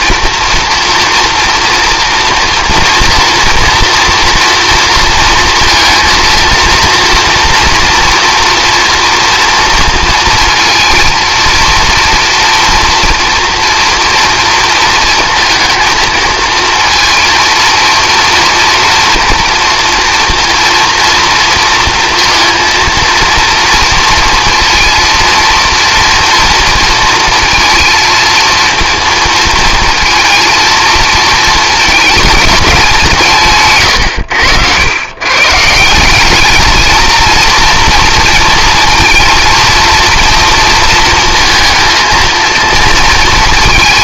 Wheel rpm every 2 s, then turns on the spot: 230, 230, 230, 230, 230, 230, 240, 230, 230, 230, 230, 230, 230, 230, 230, 230, 190, 100, 220, 230, 230, 230.
none